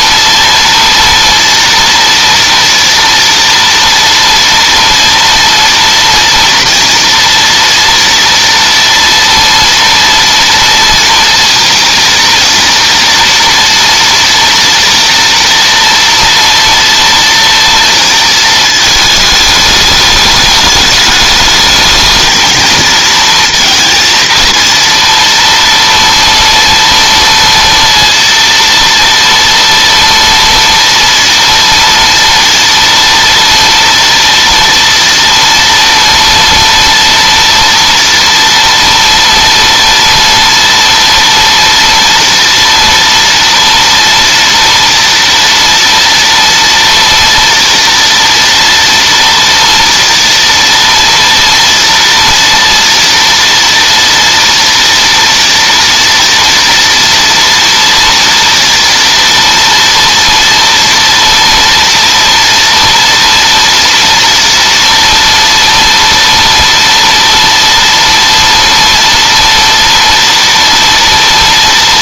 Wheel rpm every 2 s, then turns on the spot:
230, 230, 230, 230, 230, 230, 230, 230, 240, 230, 210, 220, 230, 230, 230, 230, 230, 230, 230, 230, 230, 230, 230, 230, 230, 240, 240, 230, 230, 230, 230, 230, 230, 230, 230, 230.
none